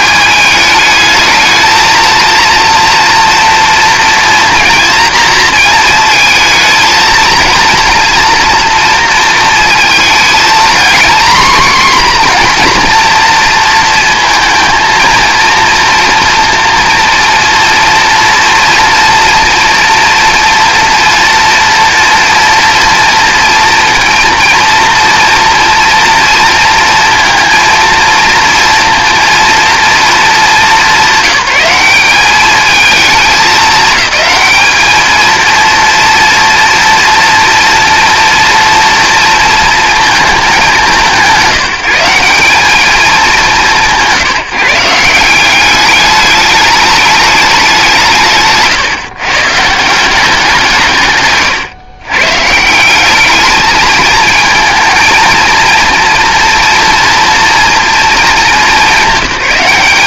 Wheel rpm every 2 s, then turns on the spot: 220, 230, 230, 230, 230, 230, 240, 230, 230, 230, 230, 230, 230, 230, 230, 190, 210, 220, 230, 230, 200, 210, 160, 210, 140, 170, 180, 220, 230, 200.
none